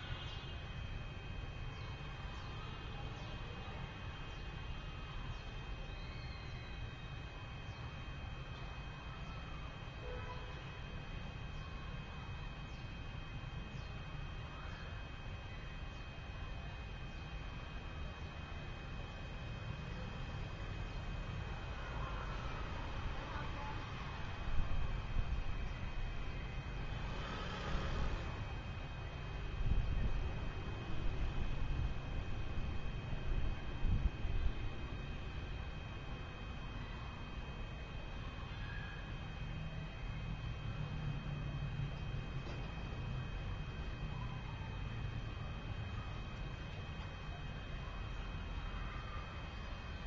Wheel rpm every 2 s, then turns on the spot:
0, 0, 0, 0, 0, 0, 0, 0, 0, 0, 0, 0, 0, 0, 0, 0, 0, 0, 0, 0, 0, 0, 0, 0, 0.
none